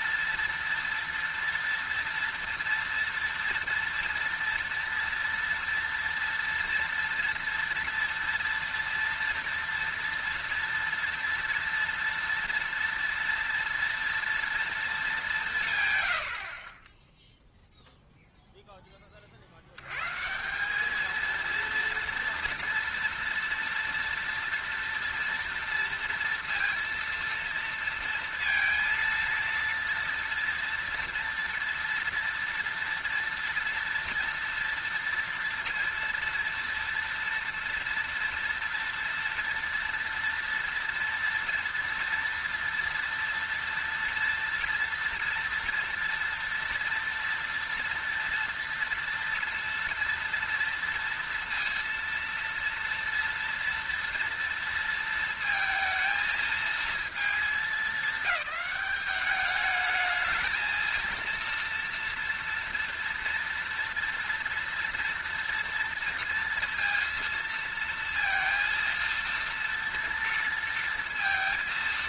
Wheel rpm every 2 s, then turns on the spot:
230, 230, 230, 230, 230, 230, 230, 230, 40, 0, 180, 230, 230, 230, 230, 230, 230, 240, 230, 230, 230, 230, 230, 230, 230, 230, 230, 230, 220, 200, 220, 230, 240, 230, 230, 230.
none